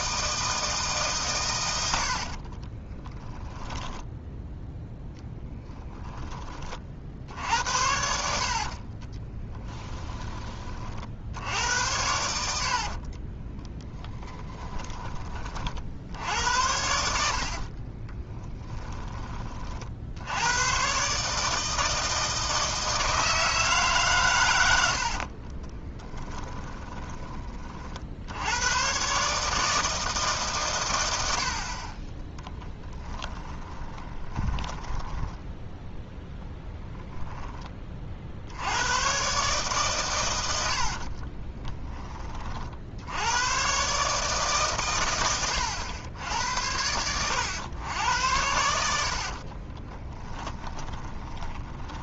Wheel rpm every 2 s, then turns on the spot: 150, 20, 0, 40, 40, 40, 60, 20, 80, 10, 120, 160, 80, 10, 110, 110, 10, 10, 10, 90, 60, 60, 120, 90, 80, 20.
2-4 8-10 12-14 18-20 24-28 34-36 40-42 46-52